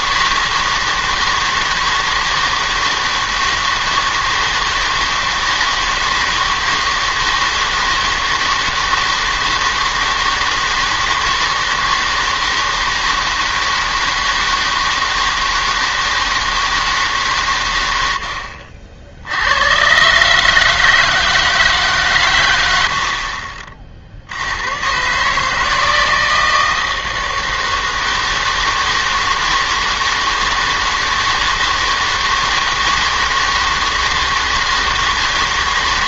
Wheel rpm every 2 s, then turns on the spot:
160, 160, 160, 160, 160, 160, 160, 160, 160, 60, 150, 80, 100, 160, 160, 160, 160, 160.
none